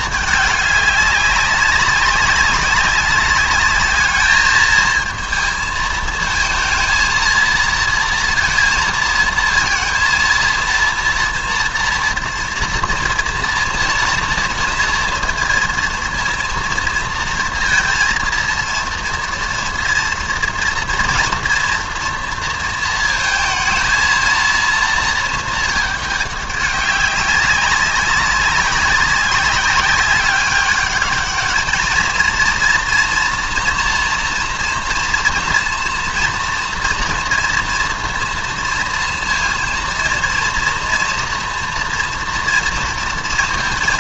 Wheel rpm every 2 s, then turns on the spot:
210, 190, 220, 230, 230, 230, 230, 230, 230, 230, 230, 230, 230, 200, 200, 200, 230, 240, 230, 230, 230, 230.
none